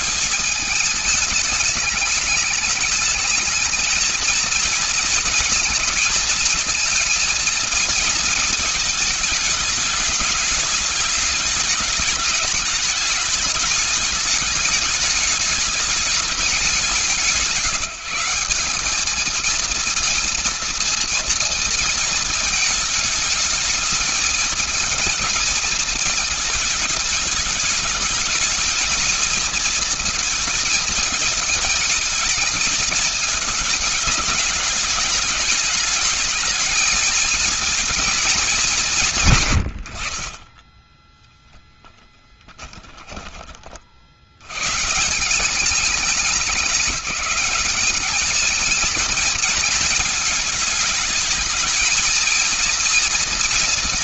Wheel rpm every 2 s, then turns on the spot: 210, 210, 230, 230, 220, 210, 210, 210, 180, 200, 230, 220, 220, 220, 220, 220, 220, 220, 220, 170, 20, 30, 150, 190, 220, 220, 230.
40-44